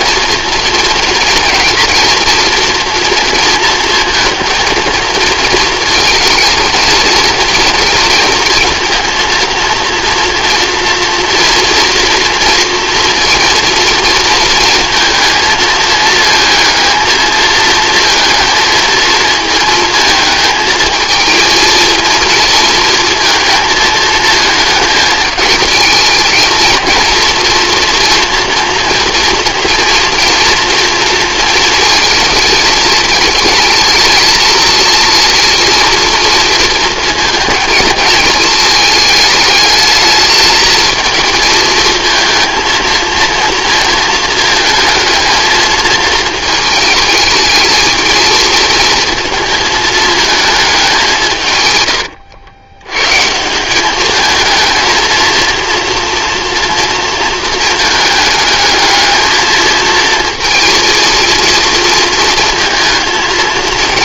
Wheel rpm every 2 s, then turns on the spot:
240, 230, 230, 230, 230, 230, 230, 220, 220, 230, 220, 230, 220, 230, 240, 230, 220, 220, 230, 220, 220, 230, 220, 220, 230, 210, 90, 220, 230, 220, 230, 230.
none